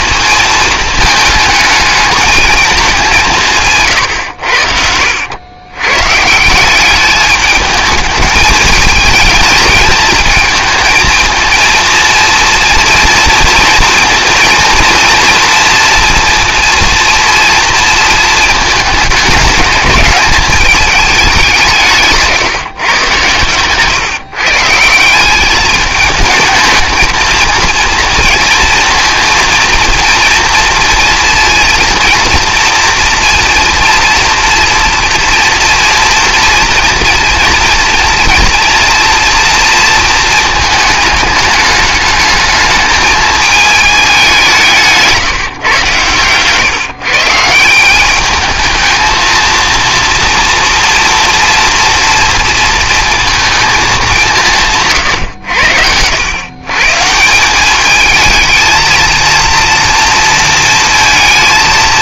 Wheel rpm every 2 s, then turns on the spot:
220, 220, 70, 180, 220, 230, 230, 230, 230, 220, 210, 140, 160, 220, 230, 230, 230, 240, 230, 230, 220, 220, 160, 130, 220, 230, 230, 160, 130, 220, 230.
none